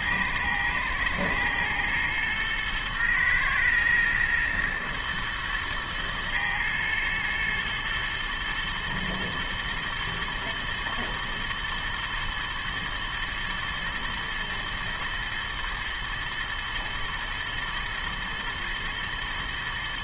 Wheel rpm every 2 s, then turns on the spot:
110, 110, 120, 110, 120, 110, 120, 110, 110, 110.
none